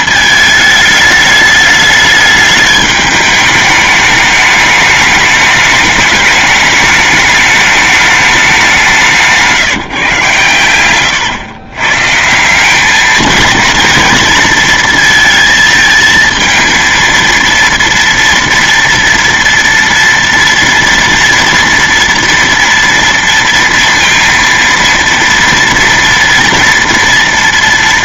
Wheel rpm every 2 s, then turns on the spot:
220, 210, 210, 210, 200, 120, 180, 230, 230, 230, 230, 230, 230, 230.
none